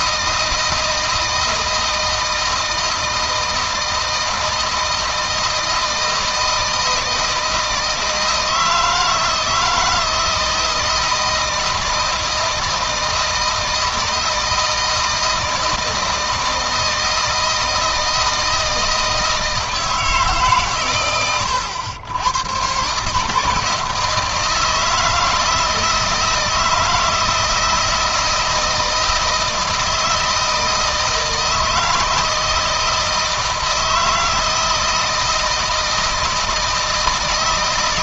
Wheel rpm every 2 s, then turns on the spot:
160, 160, 160, 160, 160, 160, 160, 160, 160, 160, 120, 130, 160, 160, 160, 160, 160, 160, 160.
none